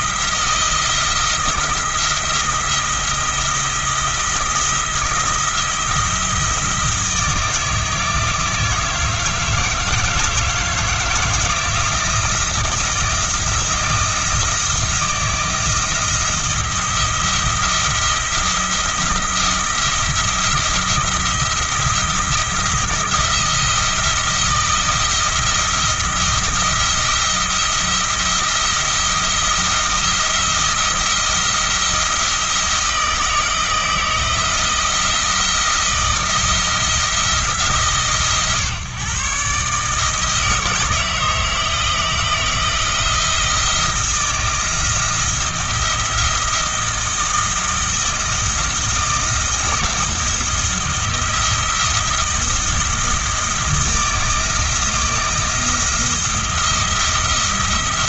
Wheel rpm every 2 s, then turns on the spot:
160, 170, 170, 160, 160, 170, 170, 170, 170, 170, 170, 170, 170, 170, 170, 170, 160, 160, 160, 130, 160, 160, 160, 170, 170, 170, 160, 170, 170.
none